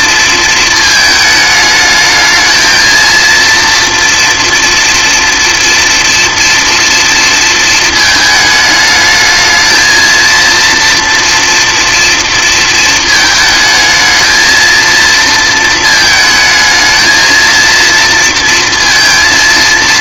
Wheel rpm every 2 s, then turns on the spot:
230, 220, 230, 230, 210, 230, 230, 230, 220, 230.
none